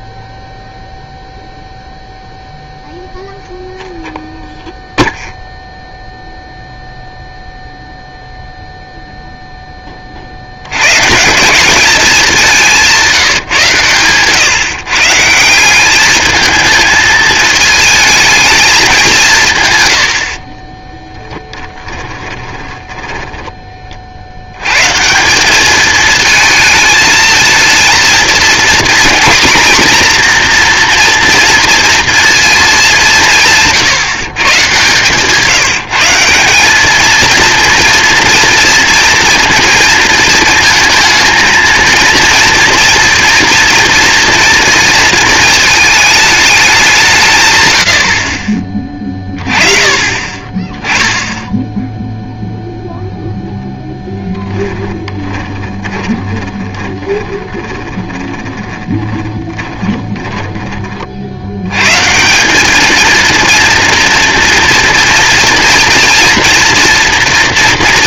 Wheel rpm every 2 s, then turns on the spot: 0, 0, 0, 0, 0, 80, 180, 140, 220, 220, 30, 10, 130, 220, 240, 240, 210, 150, 200, 230, 220, 240, 230, 190, 30, 10, 0, 10, 20, 20, 40, 220, 230, 230.
20-24 54-60